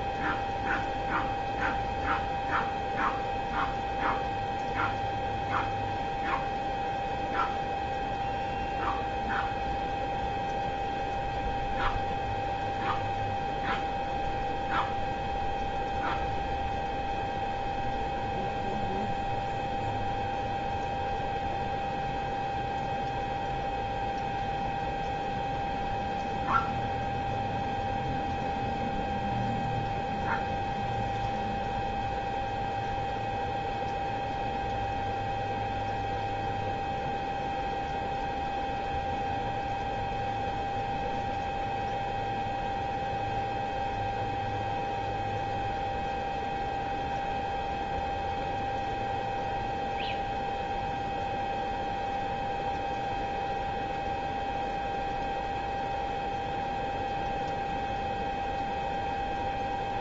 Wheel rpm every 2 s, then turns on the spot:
0, 0, 0, 0, 0, 0, 0, 0, 0, 0, 0, 0, 0, 0, 0, 0, 0, 0, 0, 0, 0, 0, 0, 0, 0, 0, 0, 0, 0, 0.
none